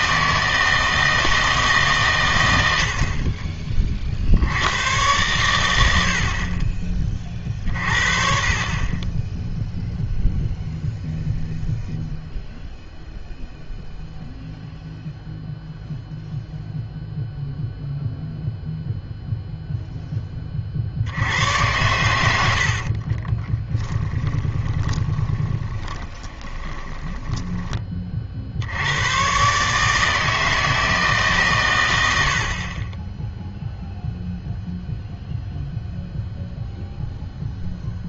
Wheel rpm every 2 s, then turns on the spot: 160, 80, 90, 30, 40, 0, 0, 0, 0, 0, 40, 50, 20, 20, 80, 160, 40, 0, 0.
22-28